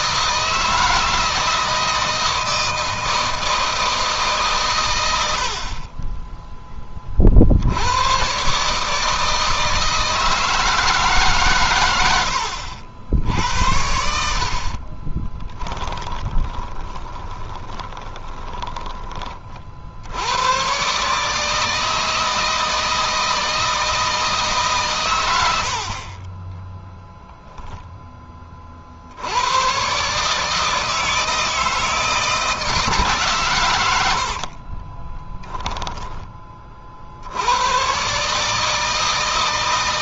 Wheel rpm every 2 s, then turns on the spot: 160, 160, 110, 30, 150, 160, 70, 40, 20, 20, 130, 160, 140, 10, 40, 160, 150, 30, 50, 160.
14-18 26-28 34-36